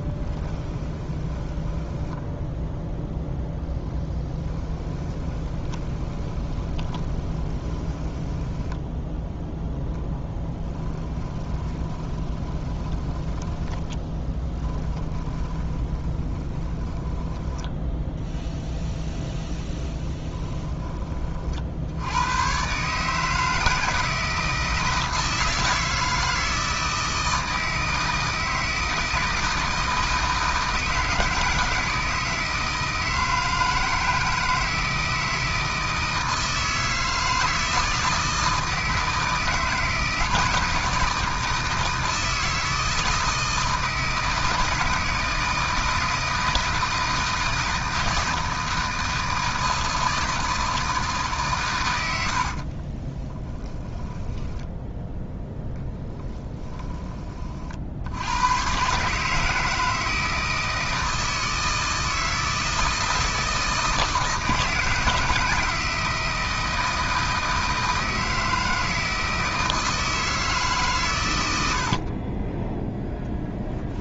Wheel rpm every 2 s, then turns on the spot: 20, 0, 10, 20, 10, 10, 20, 10, 20, 0, 20, 130, 160, 160, 160, 160, 160, 160, 160, 160, 160, 160, 160, 160, 160, 160, 40, 10, 20, 120, 160, 160, 160, 160, 160, 150, 10.
0-2 4-18 52-58